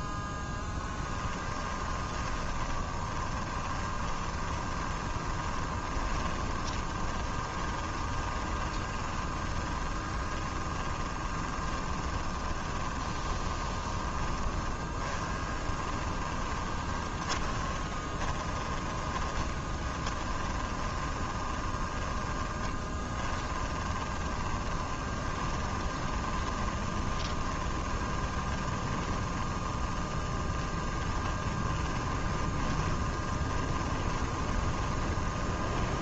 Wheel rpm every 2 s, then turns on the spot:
0, 30, 20, 20, 20, 20, 20, 30, 20, 30, 20, 20, 20, 20, 20, 20, 20, 20.
2-36